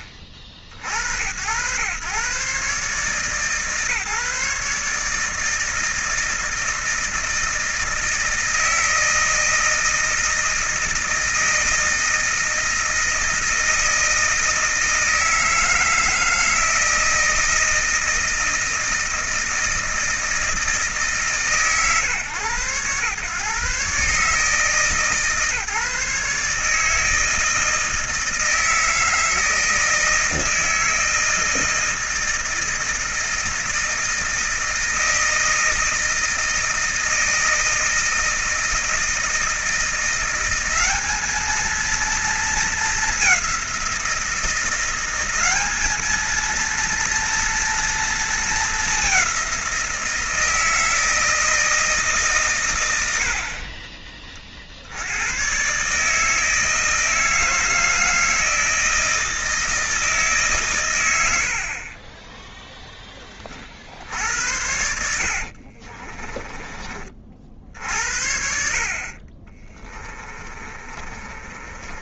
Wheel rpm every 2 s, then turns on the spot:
60, 130, 150, 160, 160, 160, 160, 160, 160, 160, 150, 120, 150, 160, 160, 160, 160, 160, 160, 160, 200, 210, 180, 230, 210, 160, 100, 80, 160, 160, 120, 10, 80, 30, 50, 30.
70-72